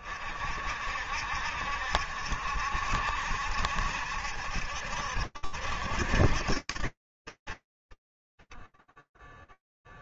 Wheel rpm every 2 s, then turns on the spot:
40, 60, 70, 60, 10.
none